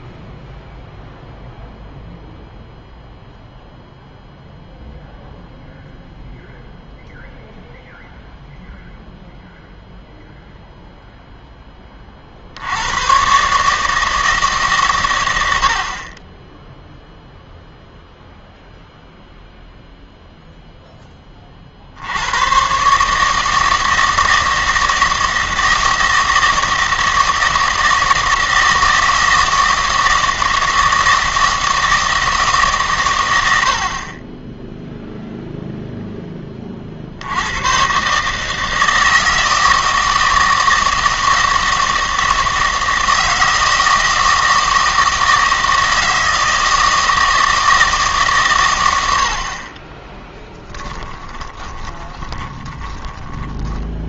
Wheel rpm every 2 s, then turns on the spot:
0, 0, 0, 0, 0, 0, 90, 140, 0, 0, 10, 130, 160, 160, 160, 160, 130, 0, 40, 160, 160, 160, 160, 160, 110, 10, 20.
50-54